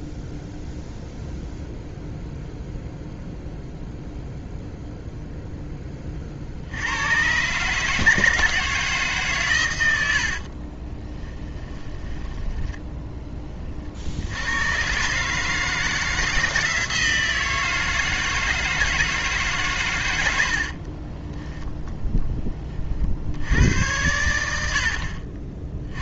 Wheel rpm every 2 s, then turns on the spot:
0, 0, 0, 60, 160, 30, 10, 110, 170, 160, 70, 30, 80.
10-14 20-22